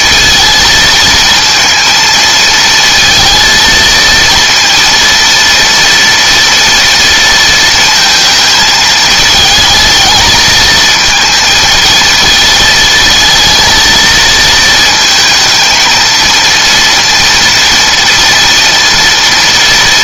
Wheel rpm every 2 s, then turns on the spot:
230, 230, 230, 230, 220, 220, 230, 220, 230, 230.
none